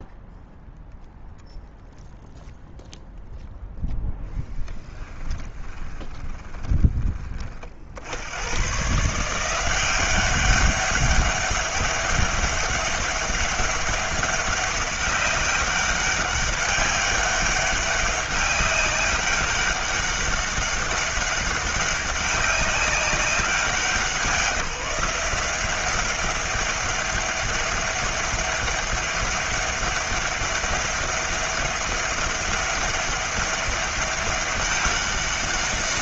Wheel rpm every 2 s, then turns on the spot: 0, 0, 10, 20, 130, 200, 200, 200, 200, 200, 200, 200, 170, 200, 200, 200, 200, 200.
4-8